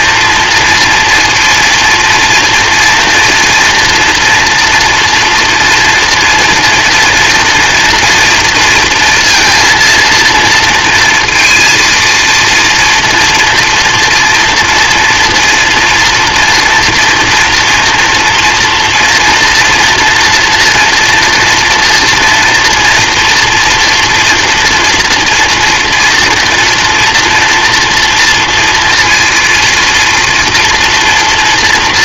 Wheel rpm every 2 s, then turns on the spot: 230, 230, 230, 230, 240, 230, 230, 230, 240, 240, 230, 230, 240, 240, 240, 230.
none